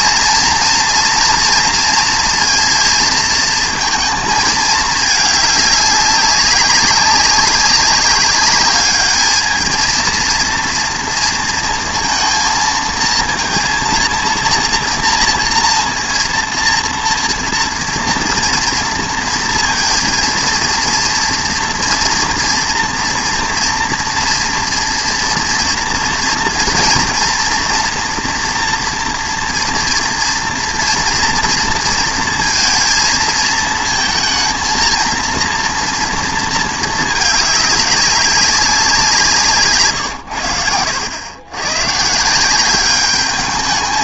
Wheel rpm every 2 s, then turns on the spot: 240, 230, 220, 200, 210, 230, 230, 230, 230, 230, 230, 230, 230, 230, 230, 230, 230, 230, 220, 190, 90, 190.
none